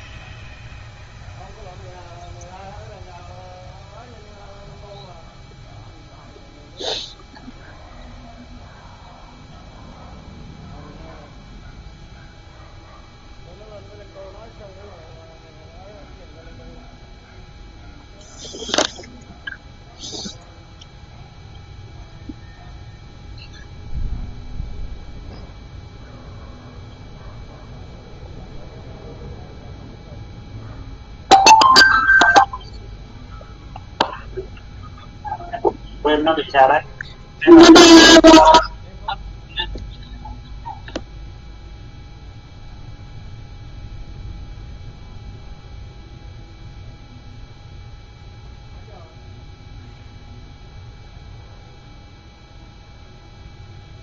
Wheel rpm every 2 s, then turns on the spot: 0, 0, 0, 0, 0, 0, 0, 0, 0, 0, 0, 0, 0, 0, 0, 0, 0, 0, 0, 0, 0, 0, 0, 0, 0, 0, 0.
none